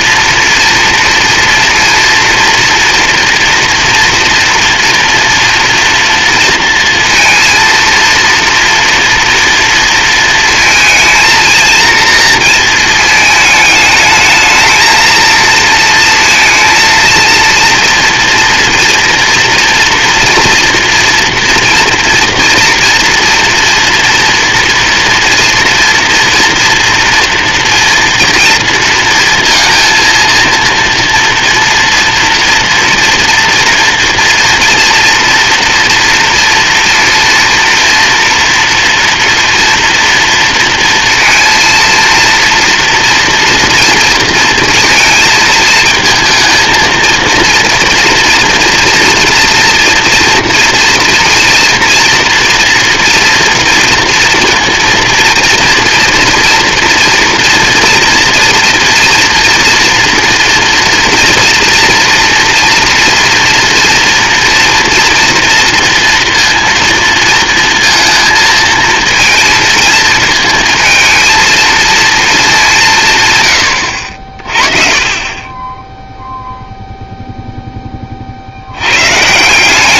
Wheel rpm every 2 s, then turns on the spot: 230, 230, 230, 230, 240, 230, 220, 220, 230, 230, 240, 240, 230, 230, 230, 230, 240, 230, 230, 240, 230, 240, 220, 230, 230, 230, 240, 230, 230, 230, 230, 230, 230, 230, 230, 220, 160, 40, 0, 90.
none